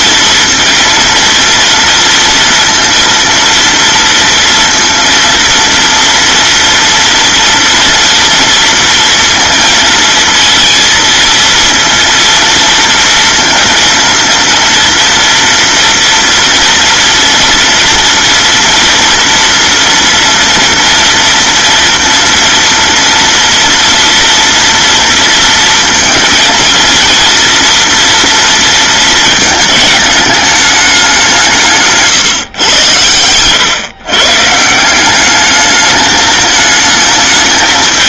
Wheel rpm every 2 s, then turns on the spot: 230, 230, 230, 230, 230, 230, 230, 230, 230, 230, 240, 230, 230, 230, 230, 210, 120, 150, 220.
none